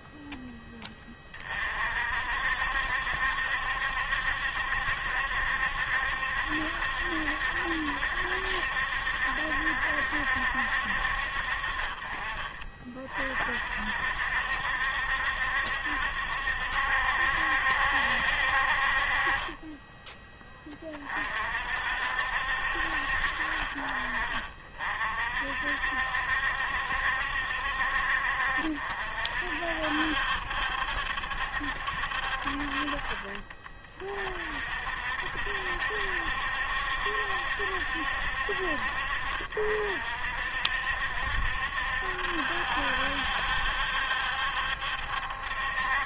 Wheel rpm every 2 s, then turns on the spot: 20, 60, 70, 70, 70, 60, 40, 70, 70, 50, 30, 60, 40, 70, 60, 70, 50, 60, 70, 60, 60, 70, 70.
none